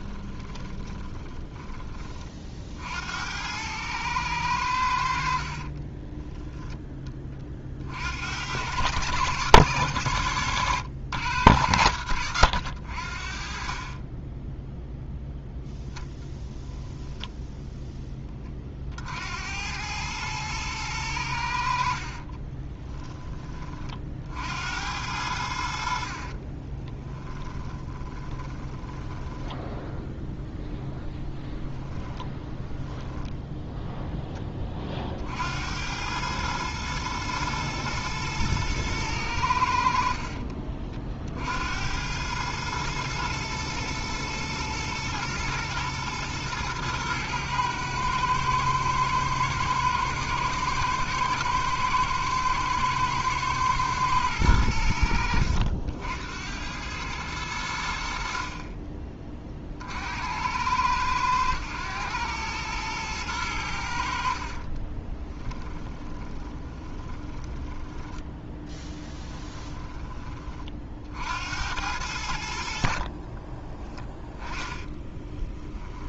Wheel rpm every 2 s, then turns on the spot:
20, 70, 70, 20, 110, 110, 70, 0, 10, 60, 100, 20, 80, 20, 10, 0, 10, 30, 110, 110, 50, 110, 110, 110, 110, 120, 110, 80, 100, 30, 100, 110, 20, 30, 10, 50, 50, 20.
0-2 16-18 22-24 26-30 32-34 64-70 74-76